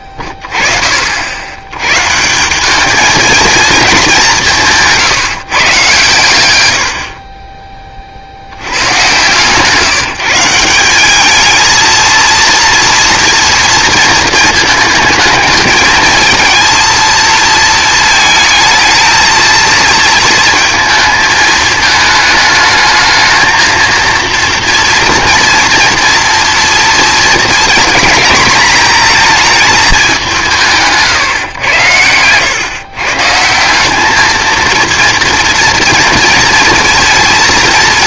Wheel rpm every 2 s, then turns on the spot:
30, 200, 170, 110, 90, 180, 230, 220, 230, 220, 220, 220, 230, 230, 220, 160, 120, 230, 230.
none